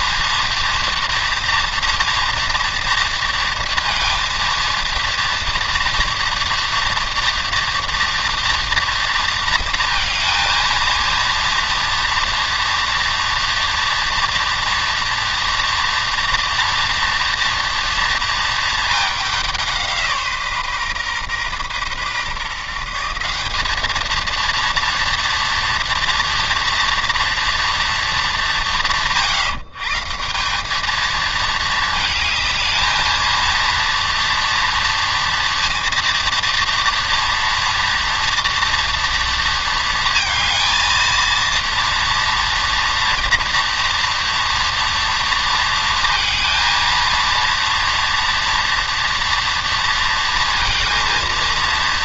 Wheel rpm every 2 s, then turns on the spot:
230, 230, 230, 230, 230, 230, 240, 240, 230, 220, 140, 150, 230, 230, 180, 200, 220, 230, 230, 230, 230, 230, 230, 230, 230, 230.
none